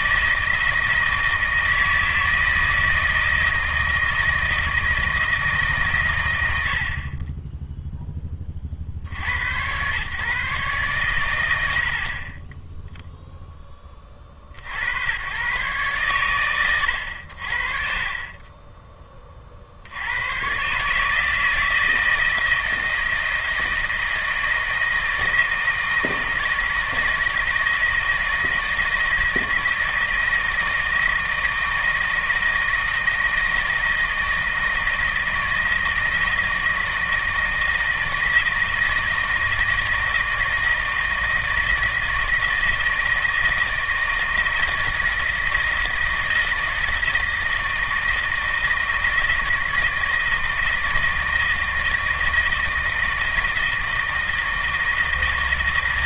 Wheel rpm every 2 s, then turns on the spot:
160, 160, 160, 80, 40, 130, 10, 60, 100, 20, 130, 160, 160, 160, 160, 160, 160, 160, 160, 160, 160, 160, 160, 160, 160, 160, 160, 160.
none